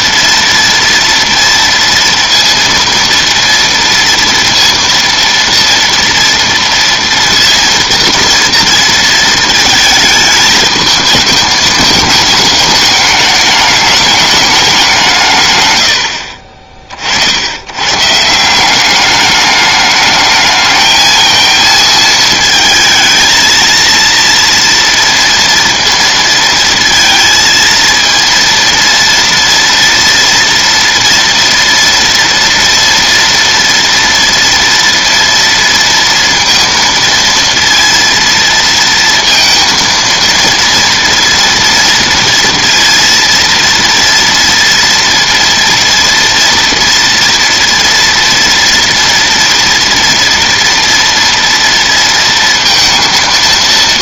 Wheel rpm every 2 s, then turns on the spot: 230, 230, 230, 230, 230, 220, 210, 200, 50, 180, 220, 220, 230, 230, 230, 230, 230, 230, 230, 230, 230, 230, 230, 240, 240, 230, 230.
none